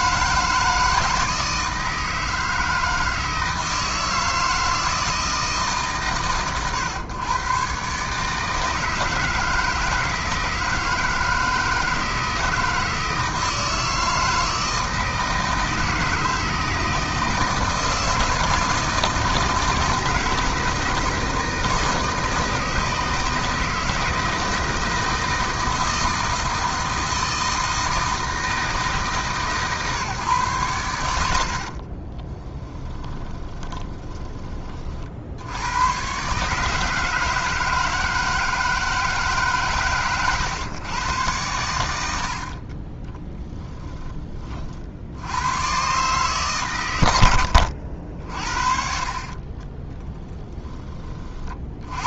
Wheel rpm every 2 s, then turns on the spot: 160, 160, 160, 120, 160, 160, 160, 160, 160, 160, 160, 160, 160, 160, 160, 110, 30, 40, 150, 160, 120, 40, 60, 120, 50, 10.
32-34 42-44